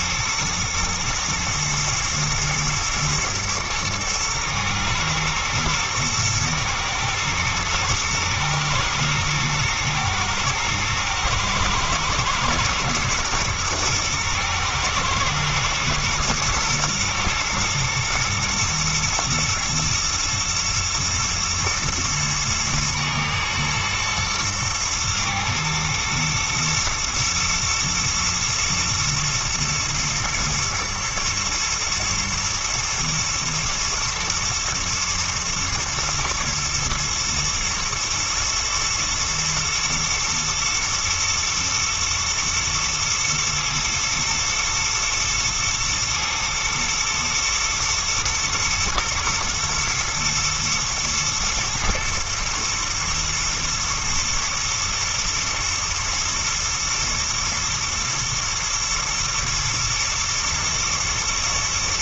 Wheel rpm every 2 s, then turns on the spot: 110, 120, 120, 110, 110, 110, 110, 120, 120, 110, 120, 110, 110, 110, 120, 110, 110, 110, 110, 120, 110, 120, 110, 120, 110, 110, 120, 110, 110, 120, 120.
none